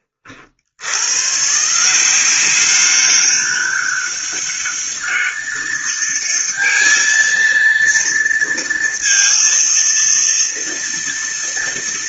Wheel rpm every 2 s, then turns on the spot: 70, 190, 200, 210, 230, 230.
none